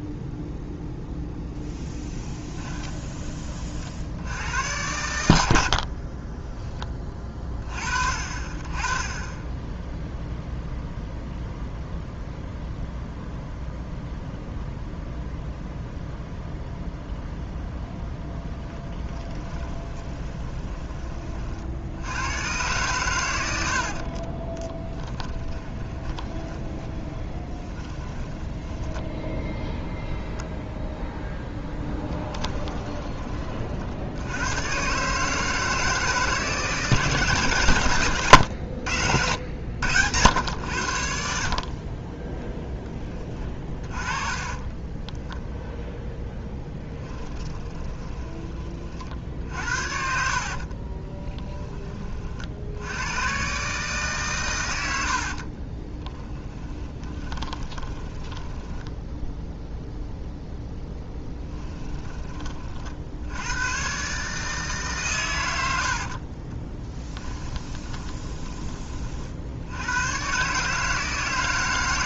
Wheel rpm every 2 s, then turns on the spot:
0, 20, 100, 20, 30, 0, 0, 0, 0, 20, 20, 110, 20, 20, 10, 0, 20, 130, 160, 90, 80, 10, 20, 10, 50, 40, 80, 90, 20, 10, 0, 40, 140, 10, 30, 150.
2-4 18-20 24-30 44-48 50-52 56-60 66-68